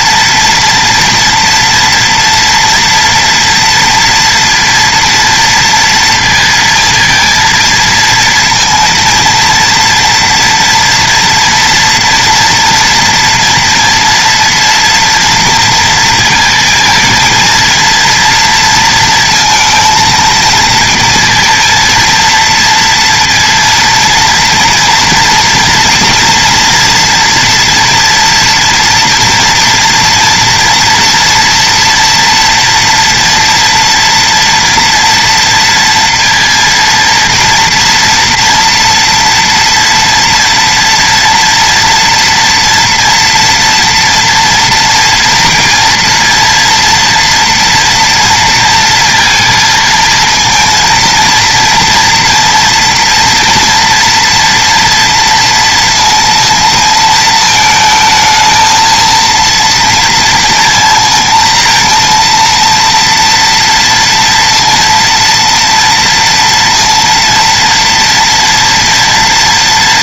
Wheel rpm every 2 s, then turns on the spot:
230, 230, 230, 230, 230, 230, 230, 230, 230, 230, 230, 230, 230, 240, 240, 230, 230, 240, 230, 230, 230, 240, 230, 230, 230, 230, 230, 230, 230, 220, 230, 230, 230, 230, 230.
none